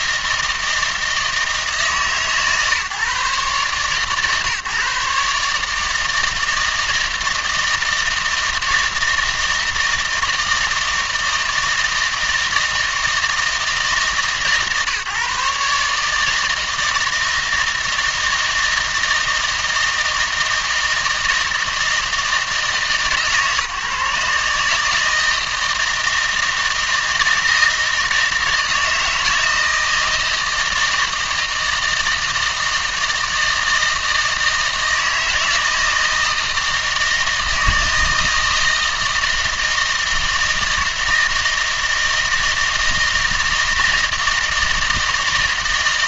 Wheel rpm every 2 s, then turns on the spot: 160, 150, 140, 160, 160, 160, 160, 150, 160, 160, 160, 160, 160, 160, 160, 160, 160, 160, 160, 160, 160, 160, 160.
none